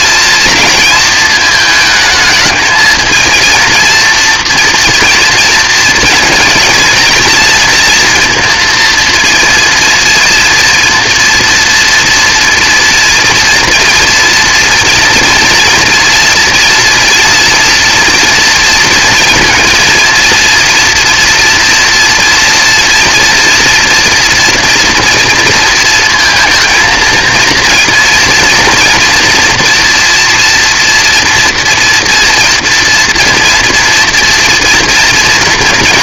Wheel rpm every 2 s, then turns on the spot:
220, 220, 230, 230, 230, 240, 230, 240, 230, 230, 230, 230, 230, 230, 230, 230, 230, 230.
none